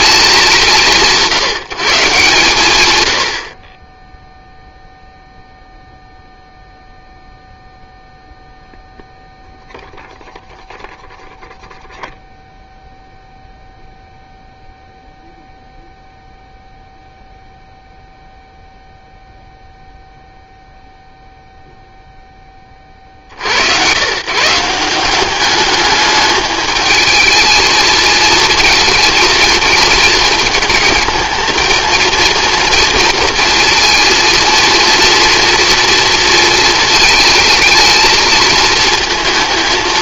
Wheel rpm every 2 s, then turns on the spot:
180, 110, 0, 0, 0, 0, 0, 0, 0, 0, 0, 40, 170, 220, 220, 220, 230, 240, 220, 220.
none